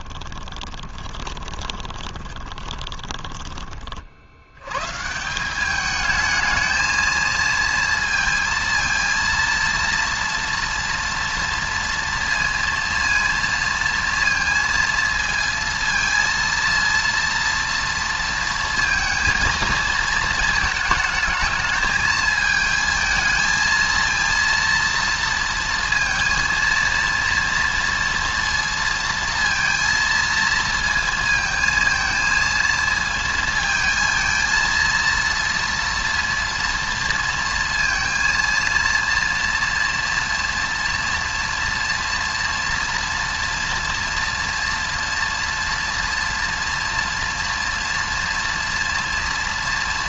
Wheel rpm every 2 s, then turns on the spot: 20, 20, 100, 220, 230, 230, 230, 230, 230, 230, 220, 220, 230, 230, 230, 230, 220, 230, 230, 230, 230, 230, 230, 230, 230.
0-4